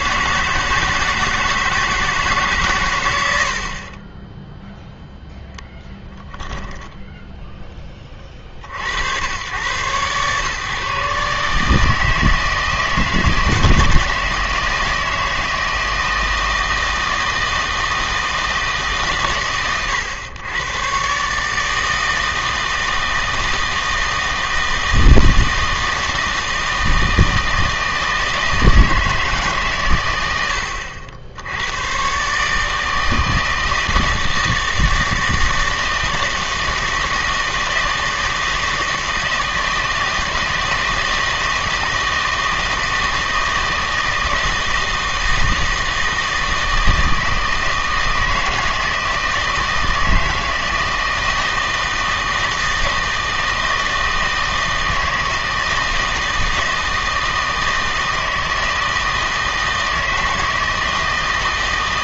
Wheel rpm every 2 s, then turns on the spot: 160, 130, 0, 0, 60, 130, 160, 160, 160, 150, 110, 160, 160, 160, 160, 80, 150, 160, 160, 160, 160, 160, 160, 160, 160, 160, 160, 160, 160, 160, 160.
none